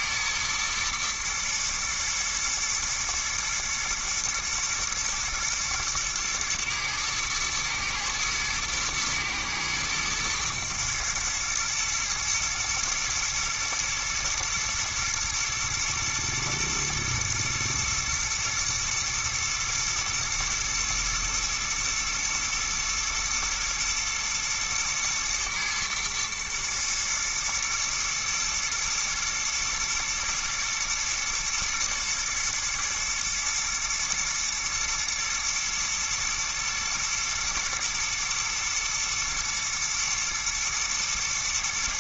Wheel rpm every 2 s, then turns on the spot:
110, 110, 110, 110, 110, 120, 110, 110, 120, 110, 110, 110, 110, 110, 110, 110, 120, 120, 120, 110, 120.
none